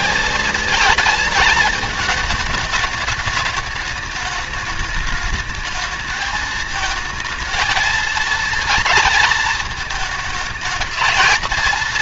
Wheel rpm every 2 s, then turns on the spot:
220, 220, 210, 220, 230, 220.
none